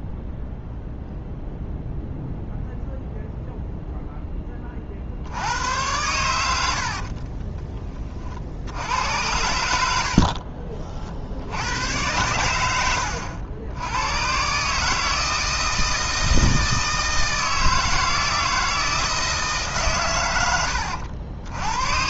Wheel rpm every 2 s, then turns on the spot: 0, 0, 20, 90, 70, 50, 100, 130, 160, 160, 100.
10-14